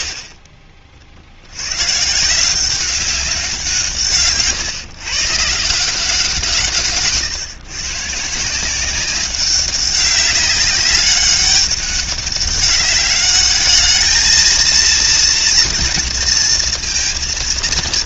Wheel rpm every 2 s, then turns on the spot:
40, 190, 130, 150, 190, 200, 200, 230, 230.
none